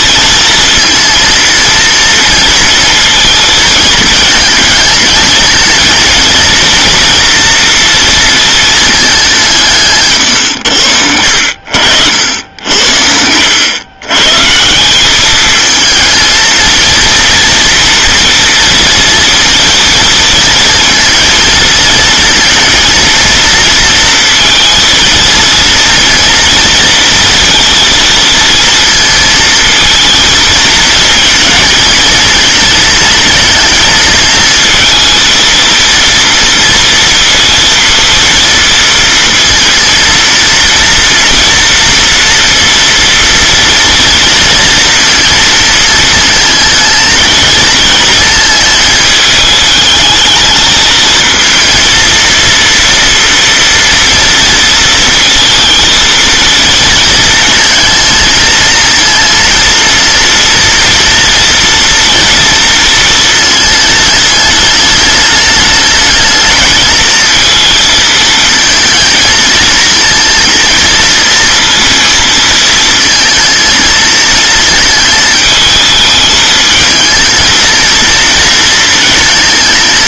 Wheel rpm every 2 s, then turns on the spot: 230, 230, 220, 230, 220, 100, 80, 160, 230, 230, 230, 230, 230, 230, 230, 220, 220, 230, 230, 230, 230, 230, 230, 230, 220, 220, 230, 230, 220, 220, 230, 230, 210, 220, 220, 230, 230, 220, 220, 230.
none